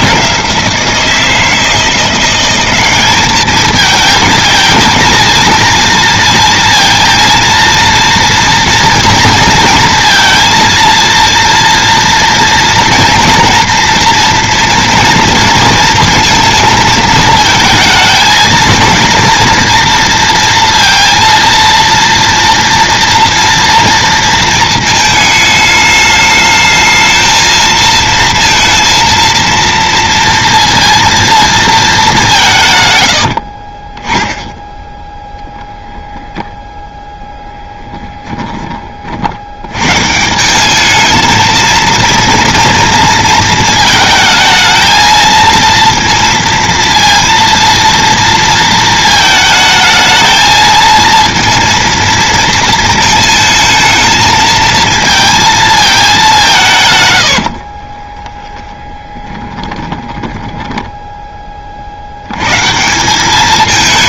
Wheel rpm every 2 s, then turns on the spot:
170, 190, 220, 230, 230, 230, 230, 230, 220, 230, 230, 230, 220, 220, 230, 230, 140, 0, 10, 20, 190, 230, 220, 230, 230, 220, 230, 220, 160, 10, 10, 130.
38-40 58-62